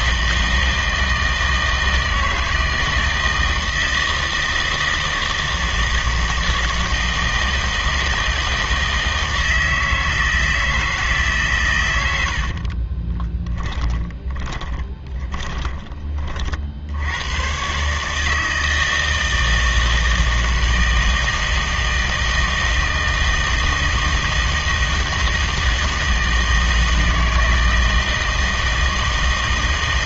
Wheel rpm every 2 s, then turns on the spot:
160, 160, 160, 160, 160, 160, 50, 20, 50, 160, 160, 160, 160, 160, 160.
12-16